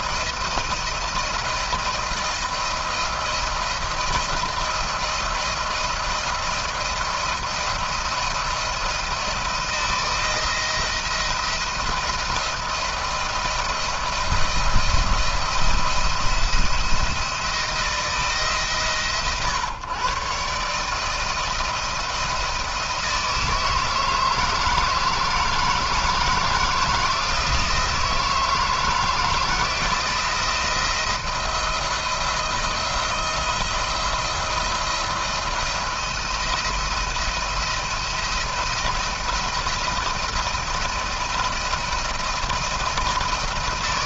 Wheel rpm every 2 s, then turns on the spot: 170, 170, 170, 170, 170, 170, 170, 170, 170, 150, 140, 170, 160, 160, 160, 170, 170, 170, 170, 170, 170, 170.
none